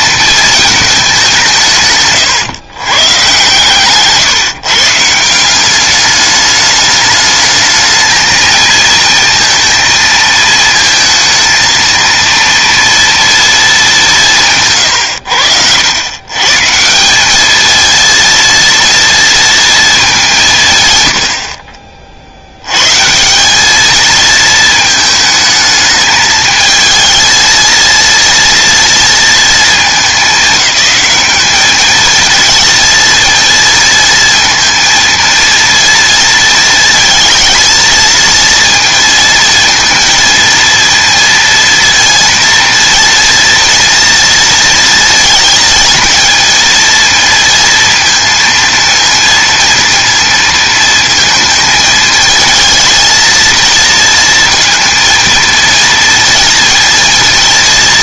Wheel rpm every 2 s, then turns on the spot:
210, 140, 150, 210, 230, 220, 230, 130, 170, 230, 120, 130, 220, 220, 230, 210, 230, 230, 230, 230, 230, 230, 230, 230, 230, 230, 230, 230, 230.
none